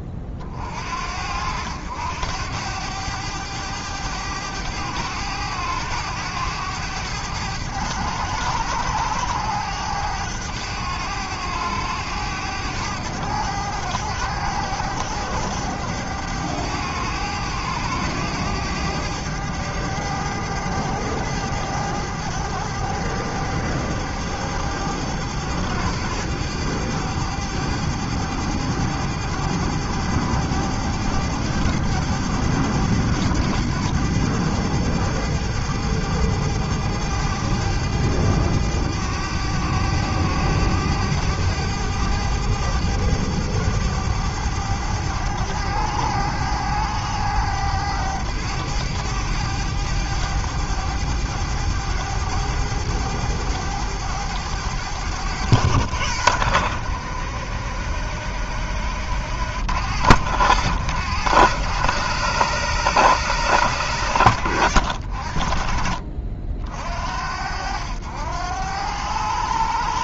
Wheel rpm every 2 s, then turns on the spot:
50, 90, 100, 100, 100, 100, 100, 100, 100, 100, 100, 100, 100, 100, 100, 100, 100, 100, 100, 100, 100, 100, 100, 100, 100, 100, 100, 100, 90, 80, 90, 120, 80, 50, 90.
none